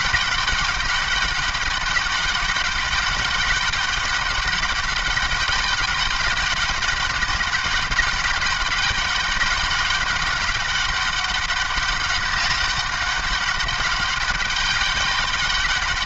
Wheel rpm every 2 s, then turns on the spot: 200, 190, 200, 200, 200, 200, 200, 200.
none